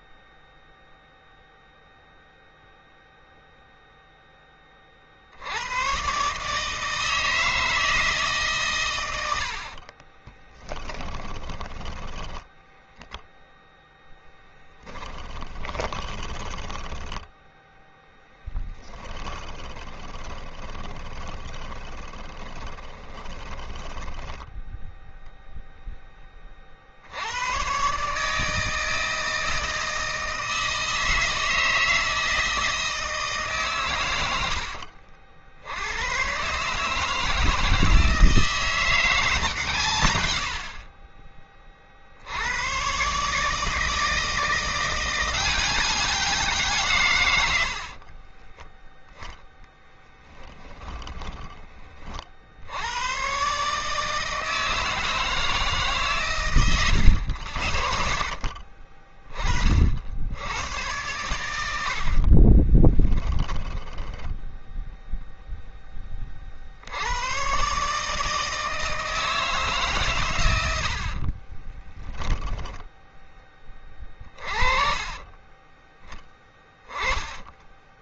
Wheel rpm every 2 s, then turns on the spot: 0, 0, 30, 150, 130, 20, 0, 10, 10, 20, 20, 20, 0, 40, 160, 160, 160, 80, 140, 170, 50, 110, 170, 160, 10, 30, 80, 160, 100, 40, 100, 30, 0, 60, 160, 90, 10, 40, 20.
10-12 14-24 34-36 48-52 56-58 62-64